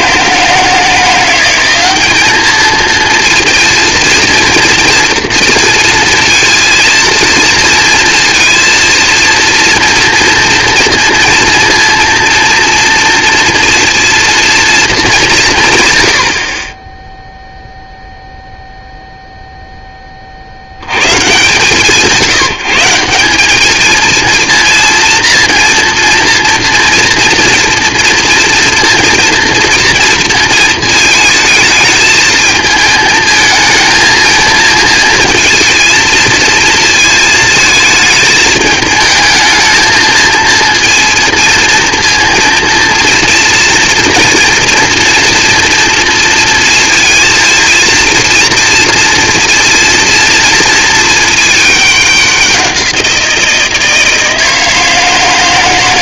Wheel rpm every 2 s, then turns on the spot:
160, 220, 230, 230, 230, 230, 230, 220, 30, 0, 40, 170, 230, 230, 230, 230, 220, 220, 230, 220, 230, 230, 230, 230, 230, 230, 190, 160.
none